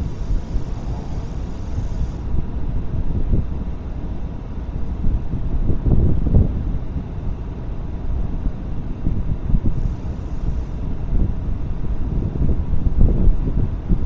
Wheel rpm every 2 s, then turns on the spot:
0, 0, 0, 0, 0, 0, 0.
none